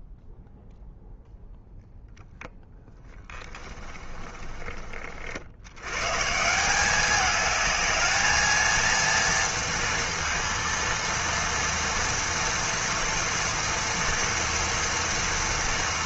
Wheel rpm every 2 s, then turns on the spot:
0, 20, 30, 170, 230, 230, 230, 230.
2-6